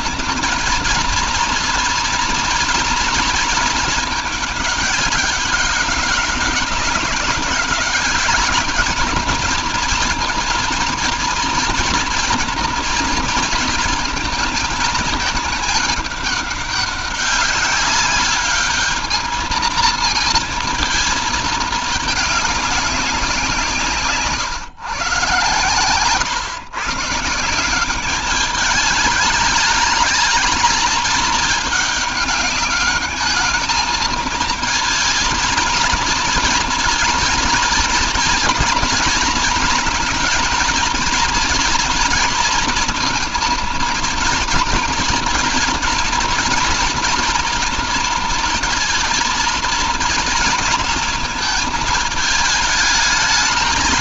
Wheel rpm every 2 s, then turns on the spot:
230, 230, 200, 200, 210, 230, 240, 220, 200, 210, 230, 200, 120, 140, 210, 220, 210, 220, 230, 230, 230, 230, 230, 240, 230, 230, 220.
none